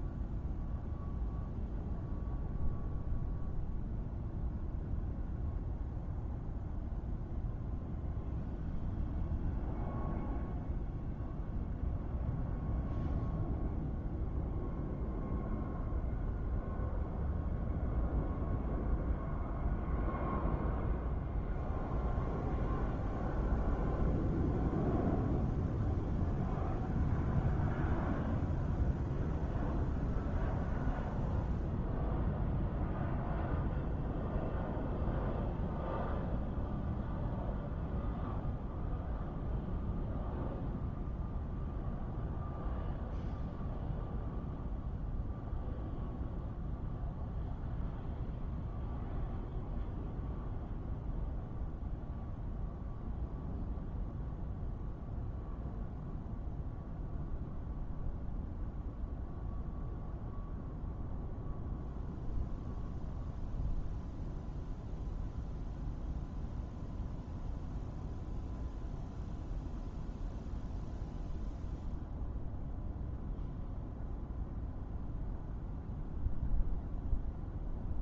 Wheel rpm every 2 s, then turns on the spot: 0, 0, 0, 0, 0, 0, 0, 0, 0, 0, 0, 0, 0, 0, 0, 0, 0, 0, 0, 0, 0, 0, 0, 0, 0, 0, 0, 0, 0, 0, 0, 0, 0, 0, 0, 0, 0, 0, 0.
none